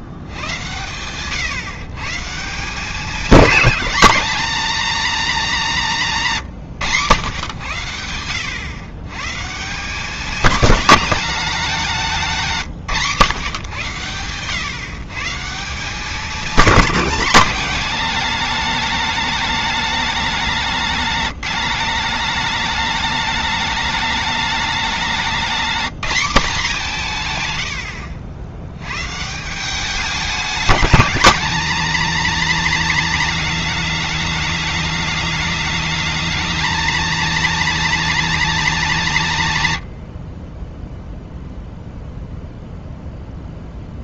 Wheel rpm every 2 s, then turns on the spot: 100, 170, 240, 140, 100, 210, 180, 120, 190, 210, 200, 210, 210, 190, 90, 200, 230, 210, 220, 230, 10, 0.
none